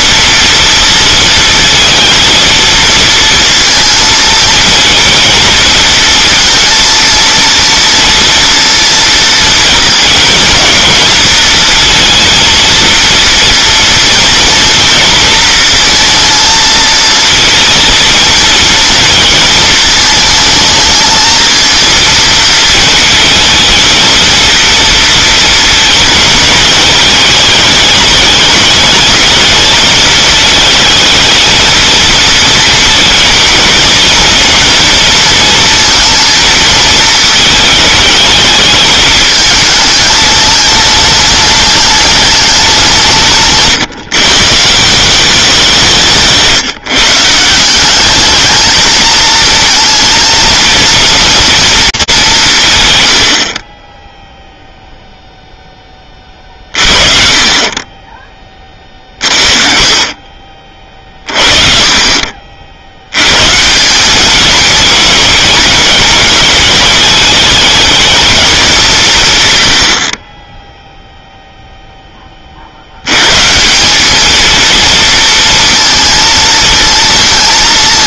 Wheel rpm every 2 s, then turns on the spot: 230, 230, 220, 230, 230, 230, 230, 230, 230, 230, 220, 230, 230, 210, 210, 220, 220, 230, 220, 210, 210, 200, 160, 150, 220, 220, 170, 0, 30, 20, 40, 50, 220, 210, 210, 10, 50, 230, 230.
none